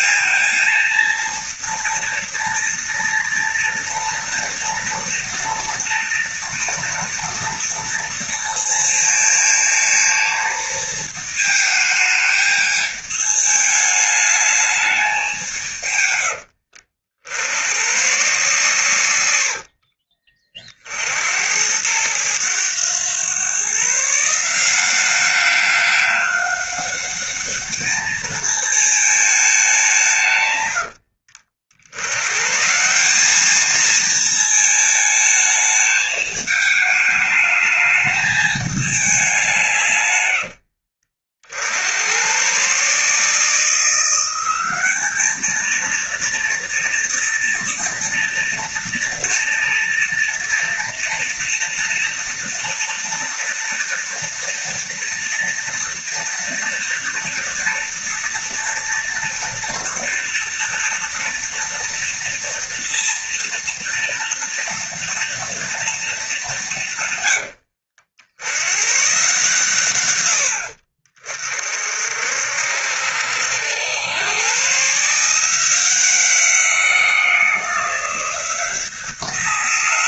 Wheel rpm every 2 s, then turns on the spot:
230, 230, 230, 230, 230, 220, 210, 200, 70, 110, 60, 110, 180, 200, 220, 80, 170, 220, 210, 200, 60, 140, 200, 230, 230, 230, 230, 230, 230, 230, 230, 230, 230, 150, 120, 50, 70, 150, 180, 180.
18-20 30-32